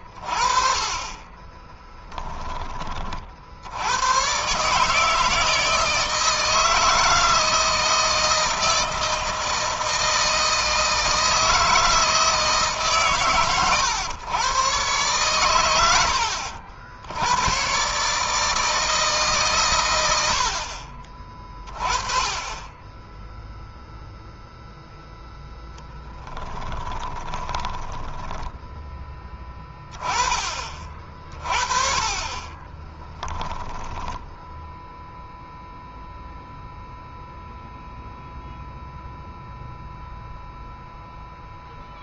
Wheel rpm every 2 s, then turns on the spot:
50, 20, 130, 160, 160, 160, 150, 120, 80, 150, 50, 10, 0, 10, 10, 30, 30, 10, 0, 0, 0.
26-28 32-36